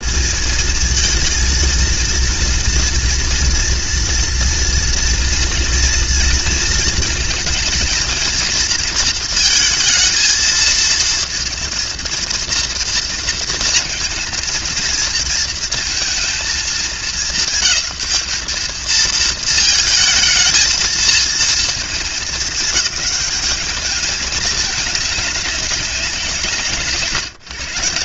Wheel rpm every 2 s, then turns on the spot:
220, 230, 230, 230, 230, 230, 230, 230, 210, 210, 220, 210, 210, 150.
none